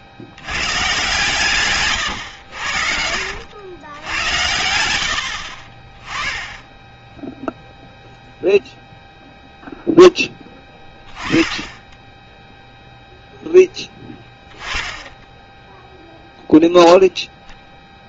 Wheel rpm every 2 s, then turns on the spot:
120, 70, 90, 10, 0, 20, 0, 10, 0.
2-4 14-16